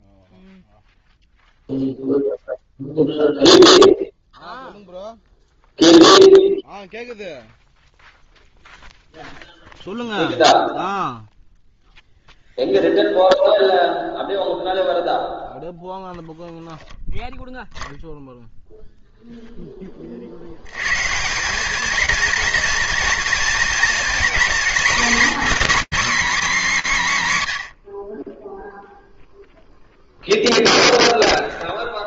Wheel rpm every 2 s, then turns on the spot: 0, 0, 0, 0, 0, 0, 0, 0, 0, 0, 170, 230, 280, 220, 0, 0.
none